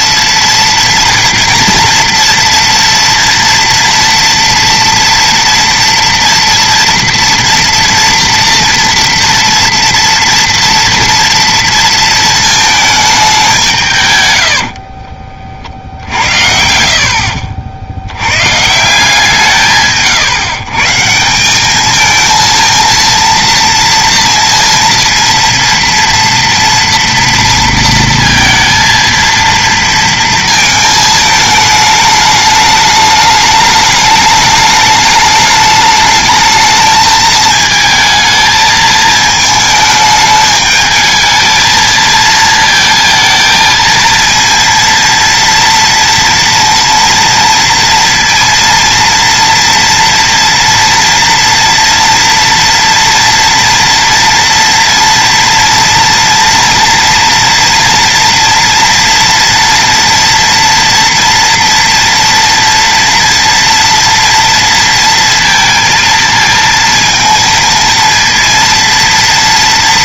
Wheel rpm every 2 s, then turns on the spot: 230, 240, 230, 230, 230, 230, 220, 120, 70, 90, 140, 220, 230, 230, 230, 230, 210, 210, 210, 220, 210, 220, 230, 230, 230, 230, 230, 230, 230, 230, 230, 230, 230, 230, 230.
14-16